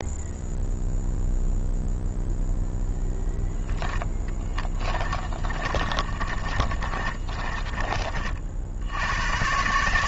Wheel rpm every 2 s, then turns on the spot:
0, 0, 30, 30, 110.
4-8